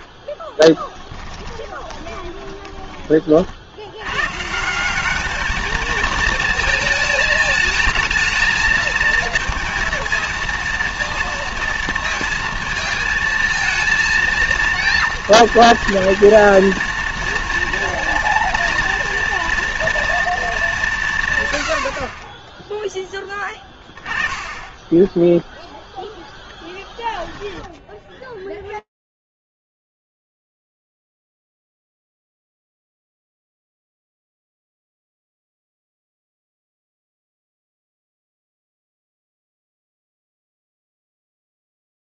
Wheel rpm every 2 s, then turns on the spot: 20, 20, 140, 220, 230, 230, 220, 230, 230, 230, 210, 10, 20, 0, 0, 0, 0, 0, 0, 0, 0.
0-4